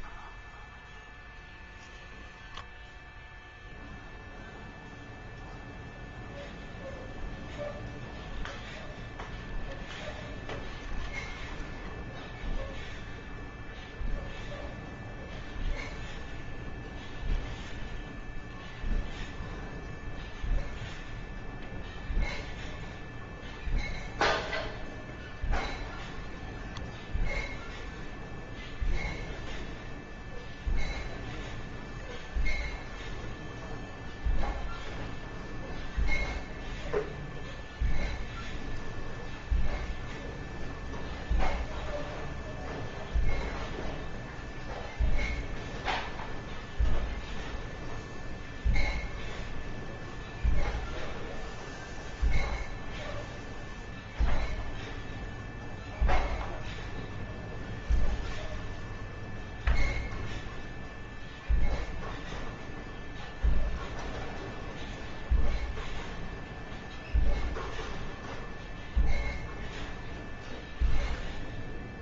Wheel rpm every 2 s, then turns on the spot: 0, 0, 0, 0, 10, 0, 0, 0, 0, 0, 0, 0, 0, 10, 0, 0, 0, 0, 0, 0, 0, 0, 0, 0, 0, 0, 0, 0, 0, 0, 0, 0, 0, 0, 0, 0.
none